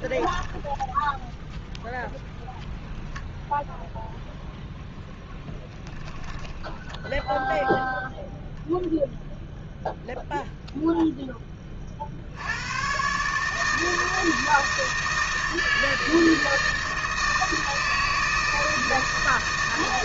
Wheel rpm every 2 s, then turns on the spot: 10, 0, 0, 10, 0, 0, 90, 160, 160, 160.
6-8